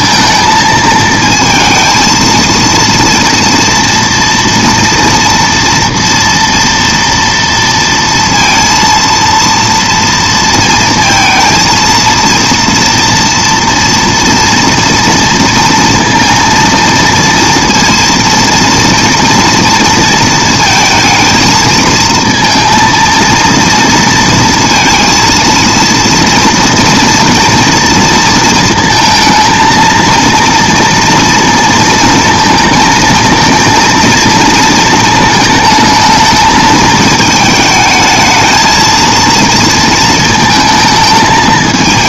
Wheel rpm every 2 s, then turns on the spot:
220, 230, 230, 230, 230, 230, 230, 230, 230, 230, 220, 230, 230, 230, 230, 230, 230, 230, 220, 220, 220.
none